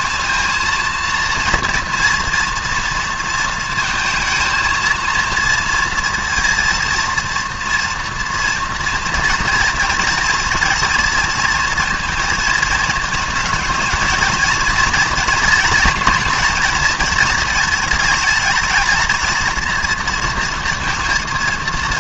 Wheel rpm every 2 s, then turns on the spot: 230, 230, 230, 230, 230, 230, 220, 230, 230, 210, 230.
none